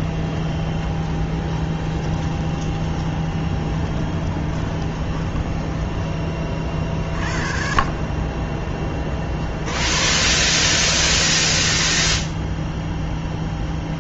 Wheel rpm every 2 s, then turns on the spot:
10, 20, 20, 40, 30, 20, 0.
2-6